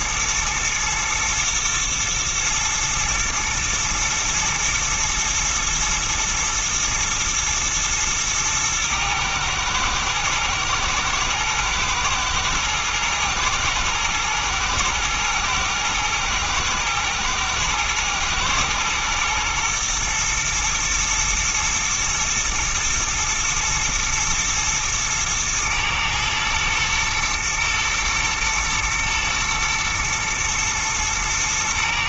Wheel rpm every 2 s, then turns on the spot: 120, 120, 110, 120, 110, 120, 120, 120, 110, 120, 110, 110, 110, 110, 110, 120.
none